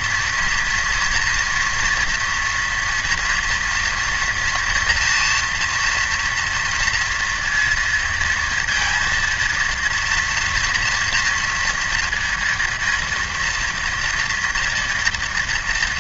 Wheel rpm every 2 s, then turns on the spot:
230, 230, 240, 230, 230, 240, 230, 230.
none